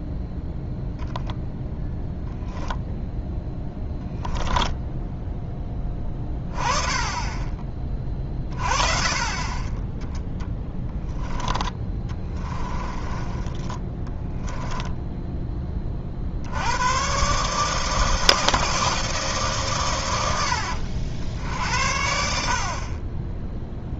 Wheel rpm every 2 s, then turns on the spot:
0, 0, 10, 20, 30, 10, 20, 10, 100, 160, 80, 40.
4-6 10-16